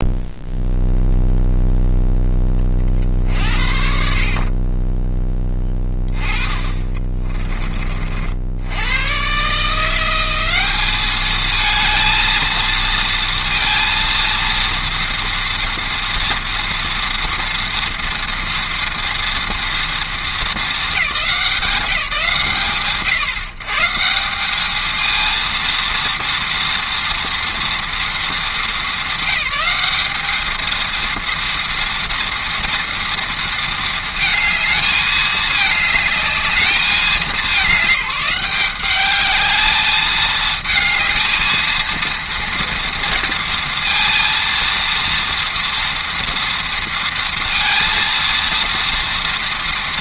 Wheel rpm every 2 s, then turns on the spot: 0, 20, 20, 30, 90, 210, 230, 230, 230, 230, 220, 90, 220, 230, 200, 230, 230, 220, 210, 200, 220, 230, 230, 230, 230.
6-8